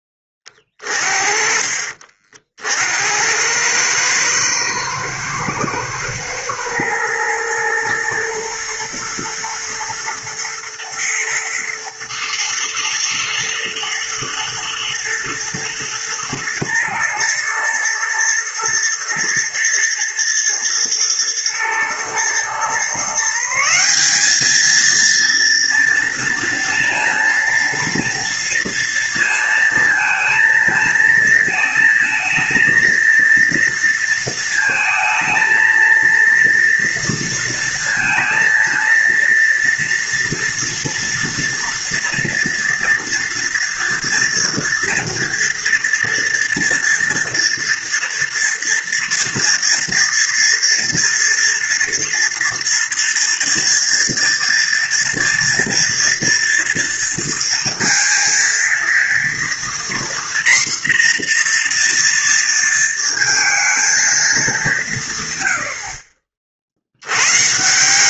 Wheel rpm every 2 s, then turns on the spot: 20, 50, 110, 110, 110, 110, 110, 120, 110, 120, 110, 120, 200, 230, 230, 230, 220, 230, 230, 230, 230, 230, 230, 230, 230, 230, 240, 230, 230, 230, 240, 230, 210, 50.
none